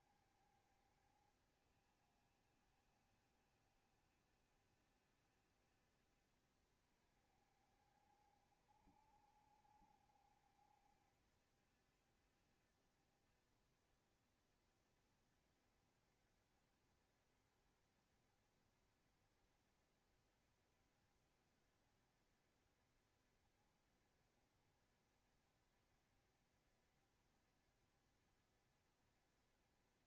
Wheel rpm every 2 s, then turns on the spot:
70, 70, 70, 60, 60, 70, 70, 60, 70, 70, 70, 70, 70, 60, 60.
none